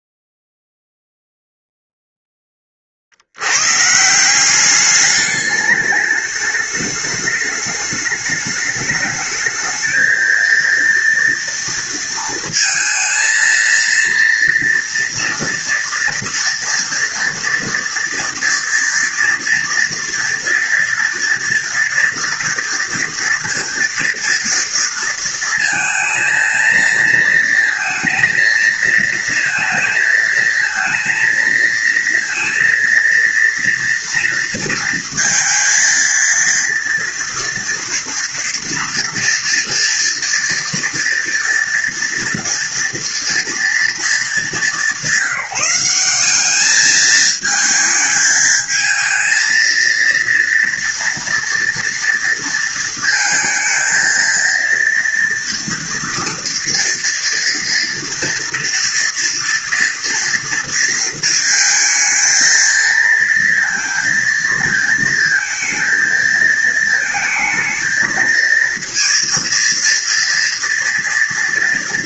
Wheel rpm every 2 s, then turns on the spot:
0, 80, 210, 210, 210, 230, 230, 230, 240, 230, 230, 230, 230, 230, 230, 220, 230, 230, 230, 230, 230, 230, 190, 220, 220, 230, 230, 230, 230, 230, 230, 230, 230, 230, 230, 230.
none